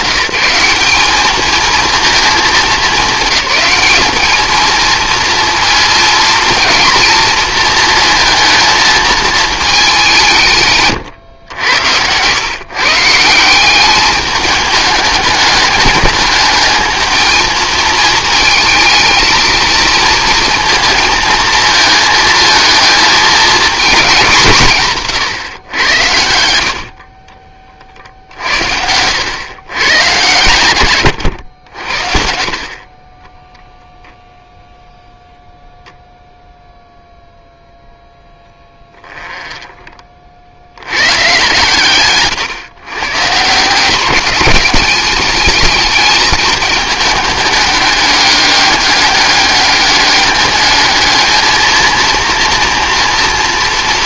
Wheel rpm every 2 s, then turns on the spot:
200, 200, 220, 220, 230, 140, 140, 210, 220, 220, 230, 220, 150, 50, 80, 120, 40, 0, 0, 10, 90, 130, 210, 210, 200, 210, 230.
38-40